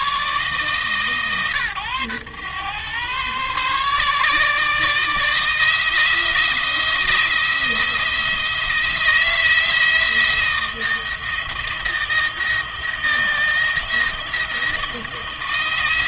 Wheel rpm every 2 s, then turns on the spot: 150, 130, 160, 170, 170, 170, 160, 160.
none